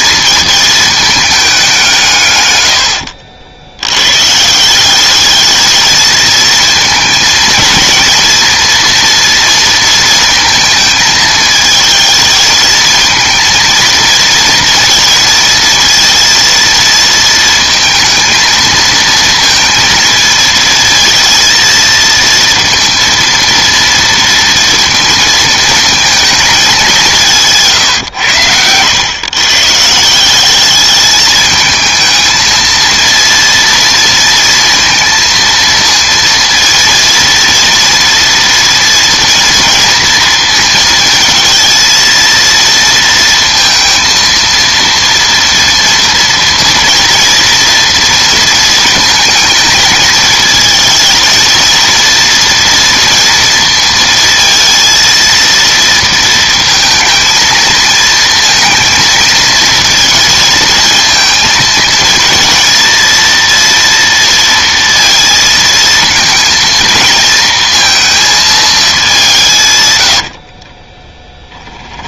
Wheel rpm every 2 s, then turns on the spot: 220, 90, 180, 230, 230, 220, 220, 220, 230, 220, 220, 230, 230, 200, 100, 200, 230, 230, 230, 230, 230, 230, 230, 230, 220, 220, 230, 230, 230, 230, 220, 230, 230, 220, 220, 30.
2-4 70-72